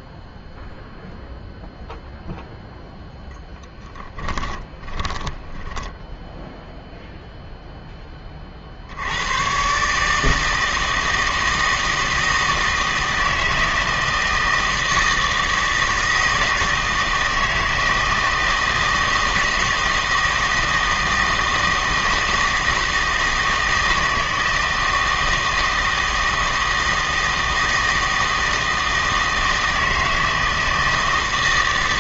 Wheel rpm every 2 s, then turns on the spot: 0, 0, 10, 0, 40, 160, 160, 160, 160, 170, 160, 160, 160, 160, 160, 160.
4-6